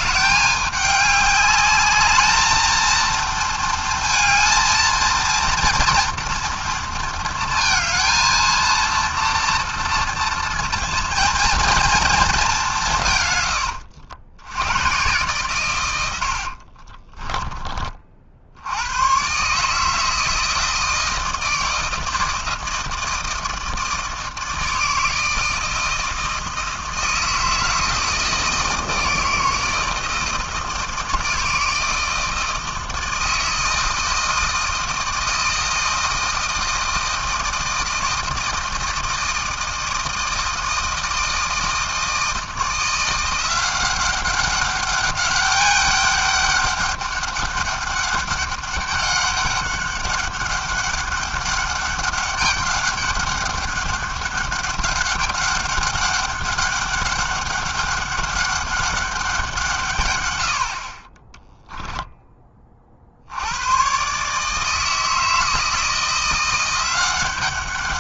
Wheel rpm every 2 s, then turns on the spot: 200, 230, 230, 230, 230, 230, 140, 130, 20, 130, 160, 160, 160, 160, 160, 160, 160, 160, 160, 160, 160, 170, 200, 200, 200, 200, 200, 200, 200, 190, 20, 80, 160, 190.
16-18